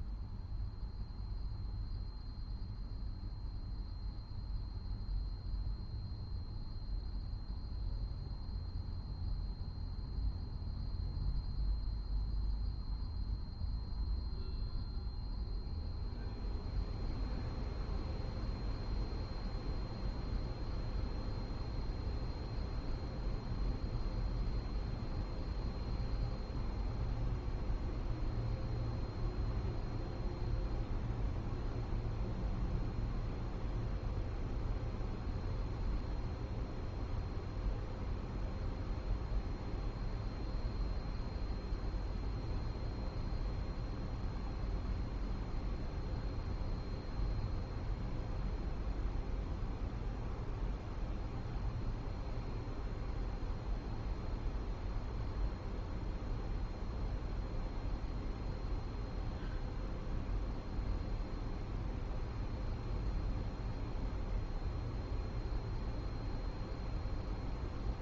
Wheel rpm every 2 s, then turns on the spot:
0, 0, 0, 0, 0, 0, 0, 0, 0, 0, 0, 0, 0, 0, 0, 0, 0, 0, 0, 0, 0, 0, 0, 0, 0, 0, 0, 0, 0, 0, 0, 0, 0, 0.
none